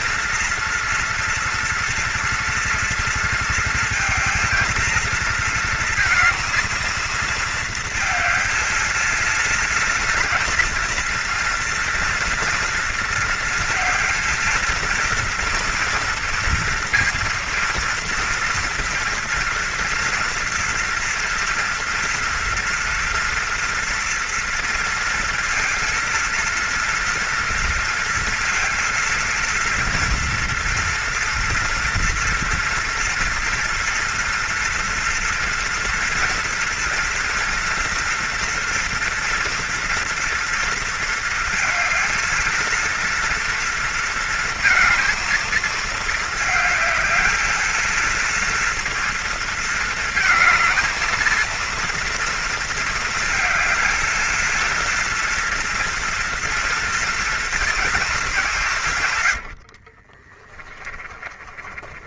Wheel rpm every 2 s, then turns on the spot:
230, 230, 230, 220, 230, 240, 230, 230, 240, 230, 230, 230, 230, 230, 230, 230, 230, 230, 230, 240, 230, 230, 230, 220, 230, 220, 230, 230, 240, 170, 20.
60-62